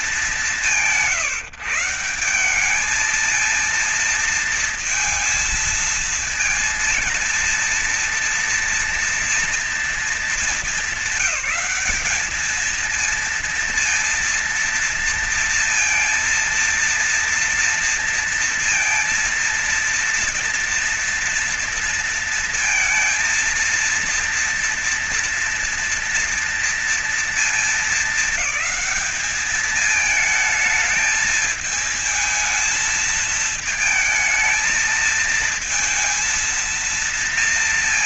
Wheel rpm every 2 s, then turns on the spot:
180, 200, 230, 230, 230, 210, 220, 230, 230, 230, 230, 230, 230, 230, 210, 220, 220, 220, 230.
none